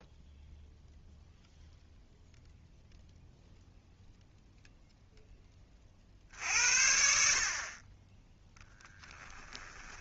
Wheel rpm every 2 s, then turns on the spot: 0, 0, 0, 60, 0.
none